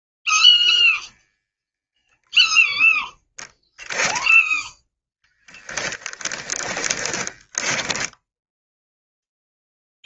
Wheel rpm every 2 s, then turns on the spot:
0, 0, 10, 10, 0.
6-8